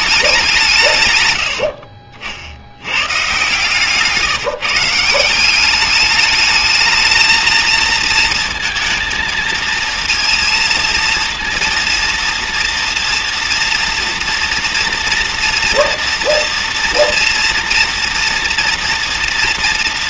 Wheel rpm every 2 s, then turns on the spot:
170, 70, 160, 210, 230, 230, 230, 240, 230, 230.
none